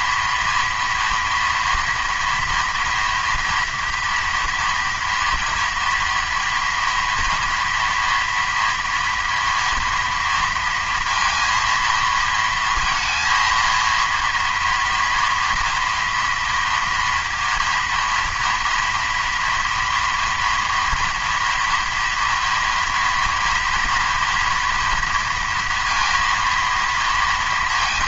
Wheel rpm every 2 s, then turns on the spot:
230, 230, 230, 230, 230, 230, 230, 240, 240, 230, 230, 230, 230, 230.
none